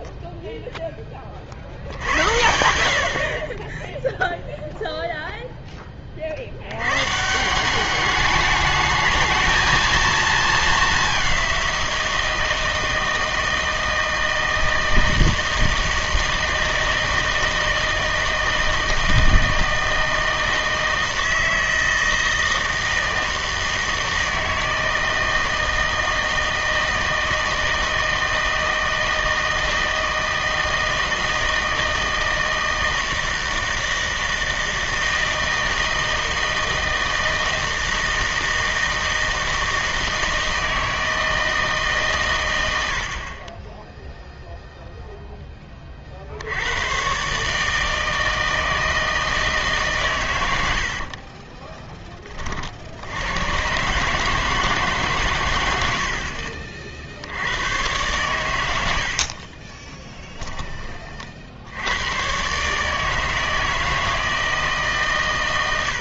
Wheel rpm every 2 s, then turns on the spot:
0, 70, 0, 100, 210, 210, 160, 160, 160, 160, 160, 160, 160, 160, 160, 160, 160, 160, 160, 160, 160, 90, 0, 90, 160, 90, 50, 150, 50, 90, 20, 140, 150.
none